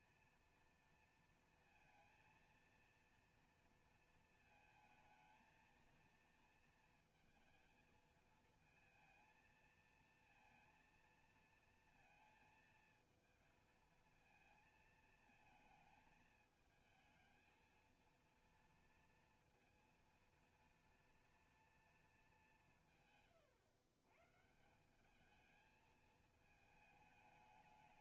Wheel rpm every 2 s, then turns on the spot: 230, 230, 220, 230, 230, 230, 230, 230, 220, 230, 230, 140, 200, 210.
none